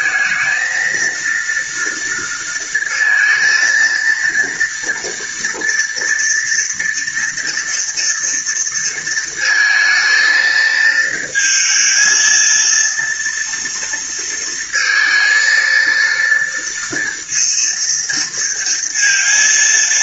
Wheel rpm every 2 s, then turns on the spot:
220, 230, 230, 230, 230, 220, 230, 230, 230, 230.
none